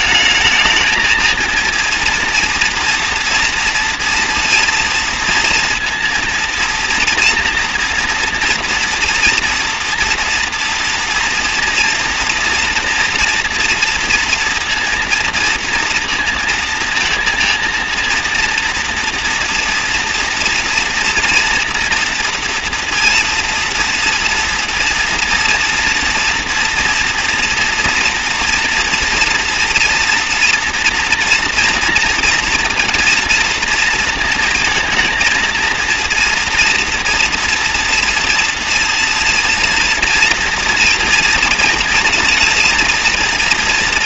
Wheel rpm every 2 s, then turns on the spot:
220, 230, 230, 230, 230, 230, 230, 230, 230, 230, 230, 230, 230, 240, 230, 240, 230, 230, 230, 230, 230, 230.
none